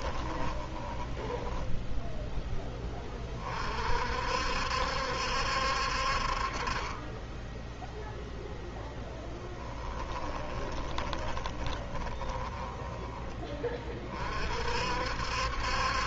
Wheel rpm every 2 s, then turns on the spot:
10, 10, 60, 30, 10, 20, 10, 50.
0-2 10-12